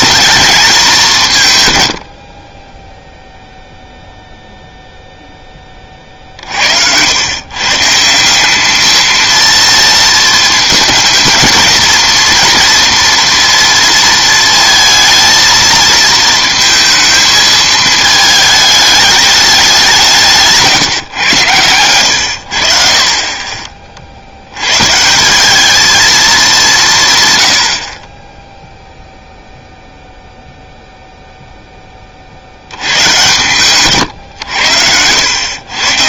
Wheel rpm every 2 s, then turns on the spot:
210, 20, 0, 60, 200, 230, 230, 220, 220, 210, 150, 60, 100, 180, 0, 0, 80, 100.
none